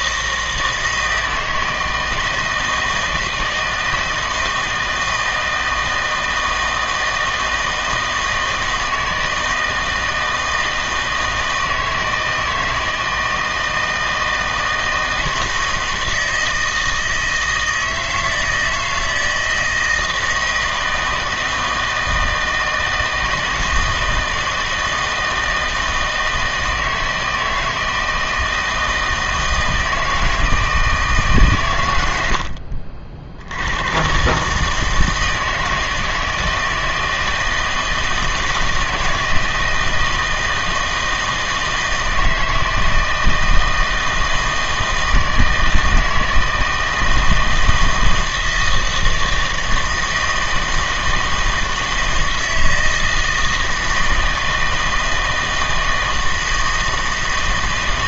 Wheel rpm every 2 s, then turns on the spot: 160, 160, 160, 160, 160, 160, 160, 160, 160, 160, 160, 160, 160, 160, 160, 160, 60, 160, 160, 160, 160, 160, 160, 160, 160, 160, 160, 160, 160.
none